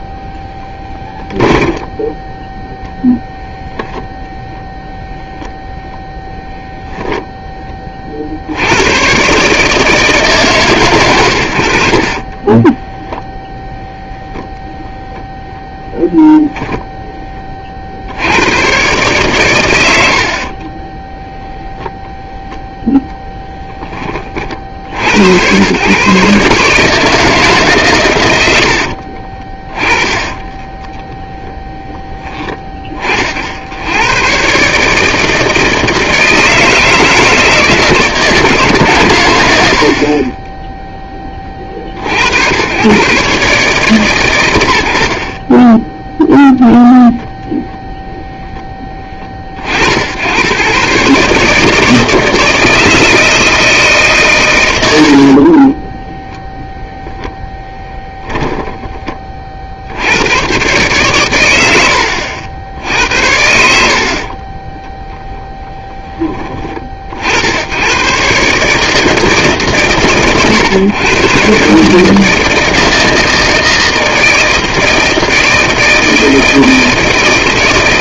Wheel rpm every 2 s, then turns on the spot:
10, 0, 0, 0, 100, 140, 10, 0, 10, 120, 30, 0, 60, 150, 80, 10, 20, 140, 160, 140, 10, 110, 80, 0, 10, 120, 160, 90, 10, 20, 120, 80, 10, 40, 150, 120, 160, 160, 160.
0-2 12-14 20-22 28-32 54-56 58-60